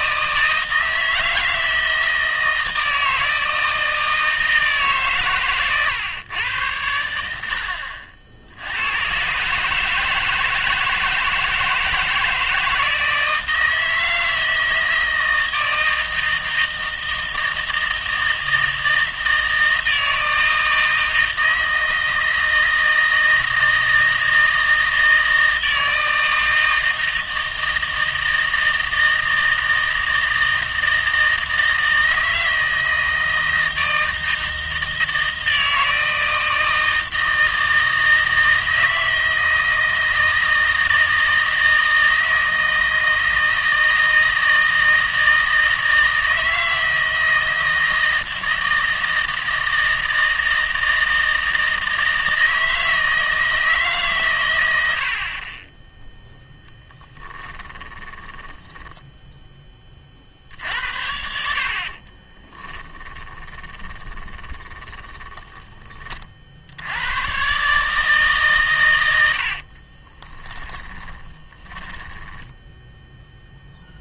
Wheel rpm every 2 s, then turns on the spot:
160, 160, 160, 100, 90, 160, 160, 160, 160, 160, 160, 160, 160, 160, 160, 160, 160, 160, 160, 160, 160, 160, 160, 160, 160, 160, 160, 100, 10, 10, 70, 20, 20, 80, 130, 10, 10.
58-60 62-66 70-74